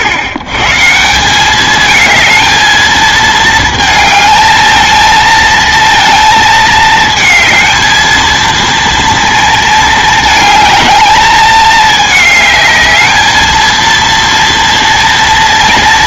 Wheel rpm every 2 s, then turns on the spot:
130, 220, 220, 220, 230, 220, 210, 230.
none